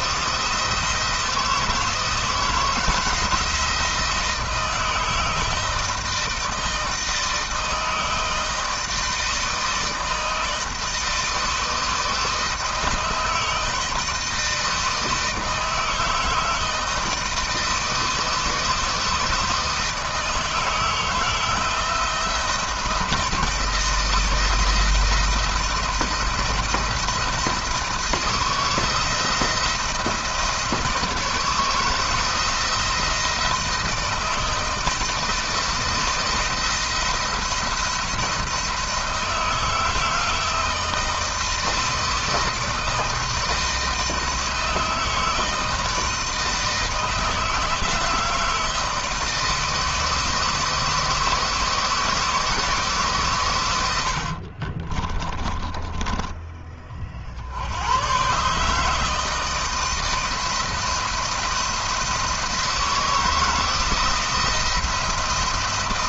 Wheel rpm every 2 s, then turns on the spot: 170, 170, 160, 160, 160, 160, 160, 160, 160, 160, 160, 160, 160, 170, 170, 160, 160, 160, 170, 160, 160, 160, 160, 160, 160, 160, 130, 20, 40, 160, 170, 160, 170.
54-56